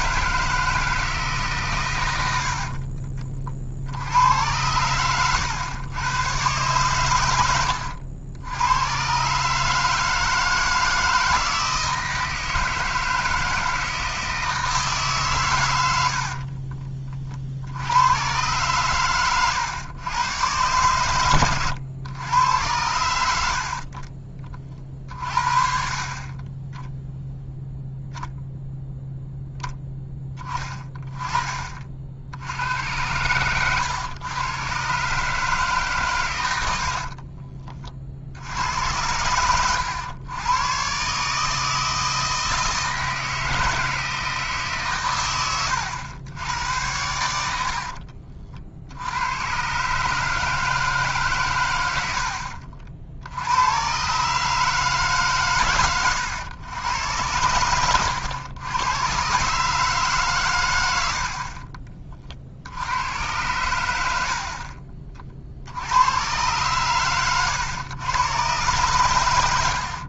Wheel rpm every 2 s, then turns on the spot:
160, 80, 110, 120, 110, 160, 160, 150, 30, 120, 120, 100, 40, 10, 10, 20, 90, 130, 80, 90, 130, 160, 140, 90, 60, 150, 60, 150, 100, 100, 100, 80, 50, 120, 130.
36-38